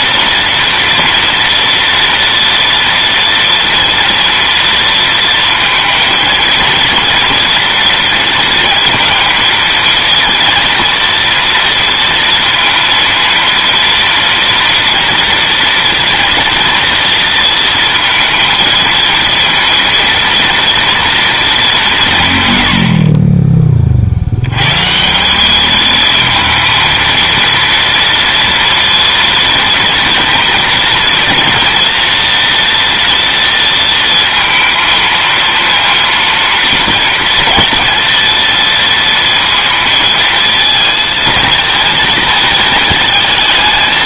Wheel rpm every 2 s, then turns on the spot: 230, 230, 230, 230, 230, 230, 230, 230, 240, 230, 230, 90, 120, 230, 230, 230, 230, 230, 230, 230, 220, 220.
none